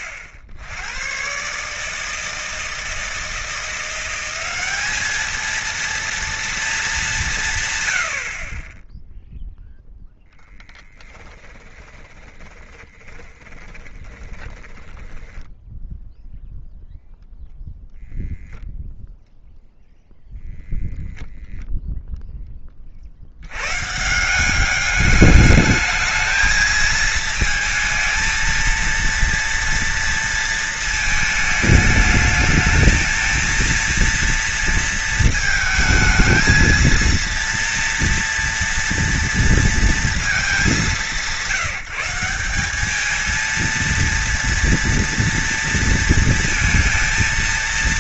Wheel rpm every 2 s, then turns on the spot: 80, 160, 200, 230, 40, 10, 20, 20, 0, 0, 0, 10, 180, 220, 220, 230, 220, 230, 220, 230, 210, 200, 230, 230.
10-16